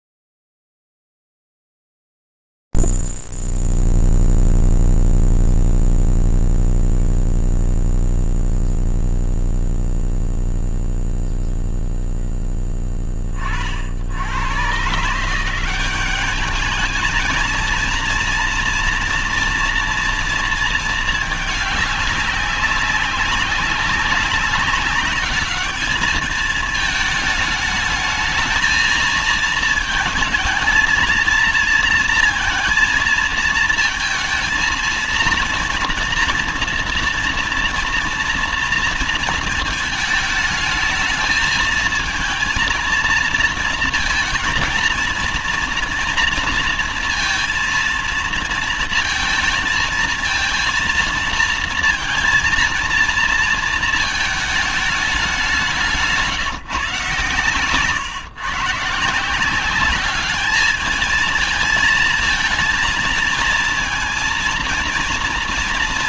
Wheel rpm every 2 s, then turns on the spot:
0, 0, 0, 0, 0, 0, 0, 90, 200, 230, 230, 200, 200, 220, 220, 230, 230, 220, 230, 230, 220, 230, 230, 230, 230, 230, 230, 210, 140, 140, 210, 230, 230.
none